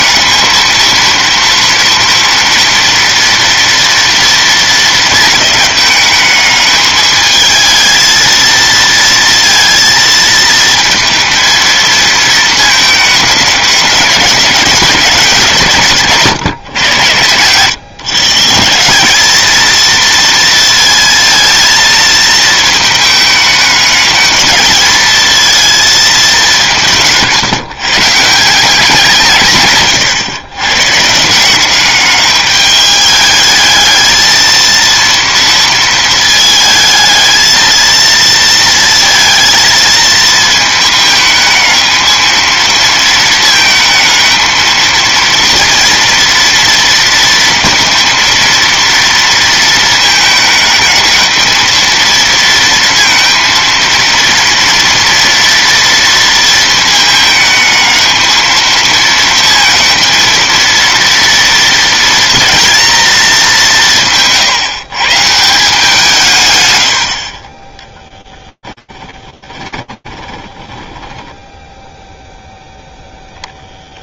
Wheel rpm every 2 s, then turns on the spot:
220, 230, 230, 210, 230, 230, 220, 190, 130, 160, 230, 230, 220, 180, 180, 120, 210, 230, 220, 230, 220, 230, 220, 230, 230, 220, 230, 230, 220, 220, 230, 230, 140, 130, 10, 20, 0.
68-72